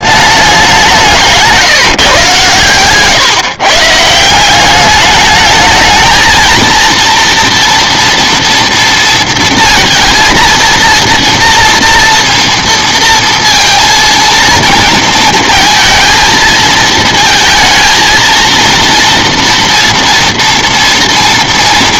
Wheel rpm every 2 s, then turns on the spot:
200, 130, 190, 230, 230, 230, 230, 230, 230, 230, 230.
none